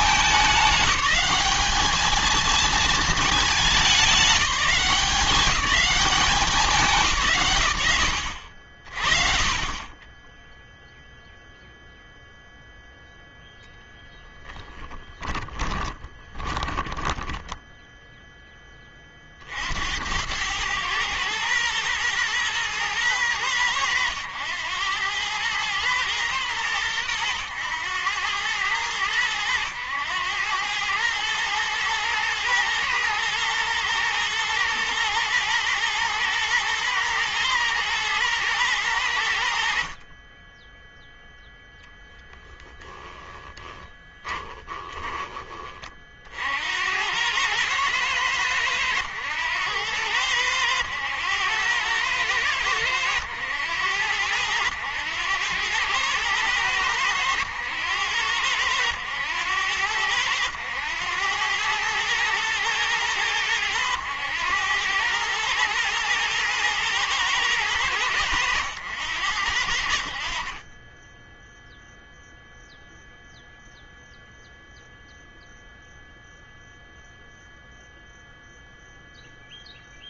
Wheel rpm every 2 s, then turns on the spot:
210, 220, 200, 180, 60, 0, 0, 10, 20, 10, 100, 120, 100, 110, 100, 100, 110, 110, 120, 110, 20, 10, 10, 50, 100, 100, 100, 90, 100, 100, 90, 110, 100, 120, 100, 40, 0, 0, 0, 0.
14-18 44-46